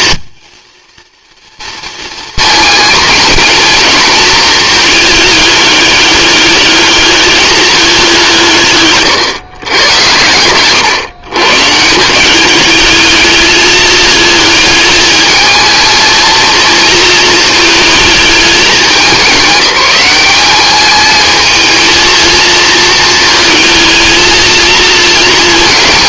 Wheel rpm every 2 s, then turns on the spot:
230, 230, 210, 210, 130, 120, 210, 220, 230, 200, 210, 220, 230.
8-10